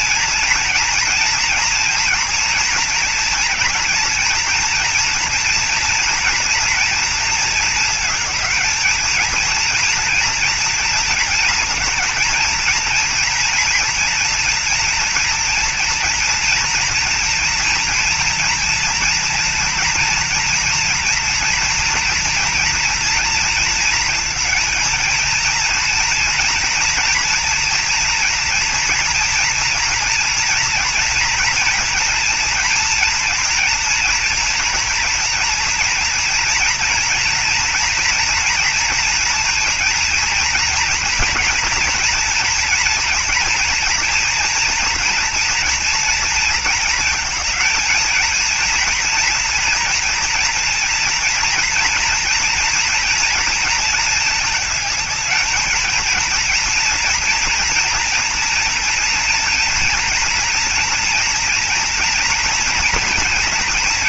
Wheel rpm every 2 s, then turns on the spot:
230, 230, 230, 230, 220, 230, 230, 230, 230, 230, 230, 230, 230, 240, 240, 230, 230, 230, 230, 230, 230, 240, 240, 230, 230, 230, 230, 220, 230, 240, 230, 230.
none